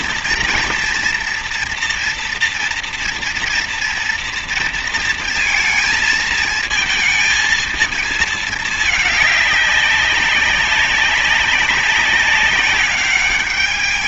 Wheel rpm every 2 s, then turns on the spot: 230, 230, 230, 220, 220, 190, 190.
none